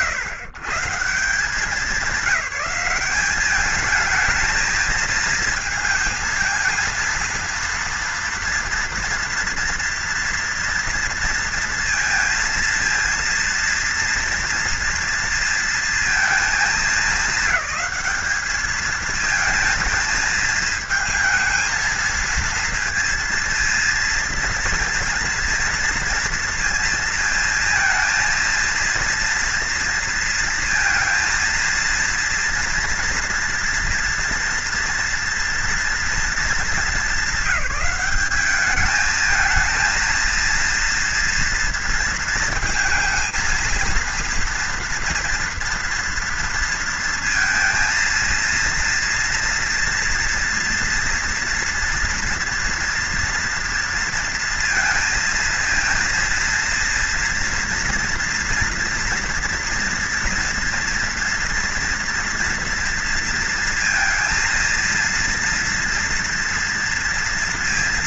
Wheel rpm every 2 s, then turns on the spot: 160, 190, 220, 230, 230, 230, 230, 230, 220, 220, 220, 230, 230, 220, 230, 230, 230, 230, 230, 210, 230, 230, 230, 230, 230, 230, 230, 230, 230, 230, 240, 230, 230, 230.
none